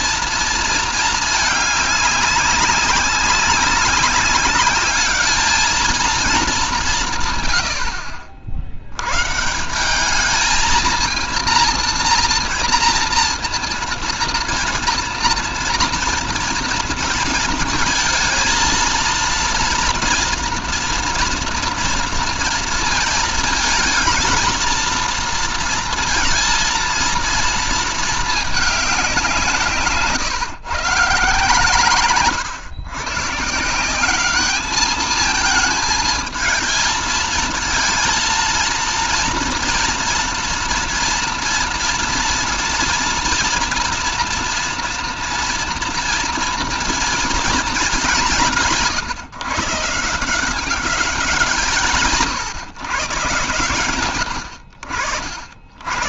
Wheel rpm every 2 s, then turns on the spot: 220, 200, 210, 180, 100, 220, 230, 230, 230, 230, 230, 230, 230, 230, 200, 150, 110, 210, 230, 230, 230, 240, 230, 240, 160, 190, 130, 60.
none